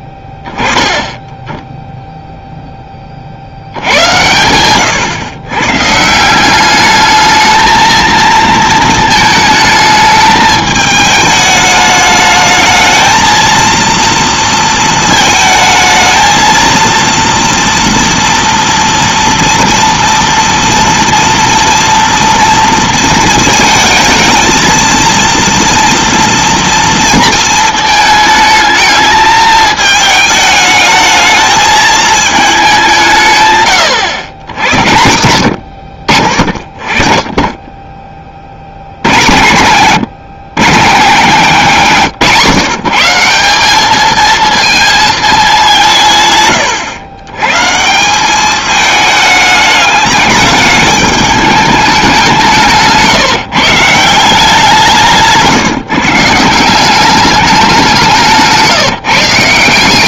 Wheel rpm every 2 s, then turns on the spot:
10, 10, 110, 200, 220, 210, 220, 230, 230, 230, 230, 230, 220, 230, 220, 220, 200, 90, 30, 60, 150, 150, 220, 110, 210, 210, 150, 170, 180, 160.
52-54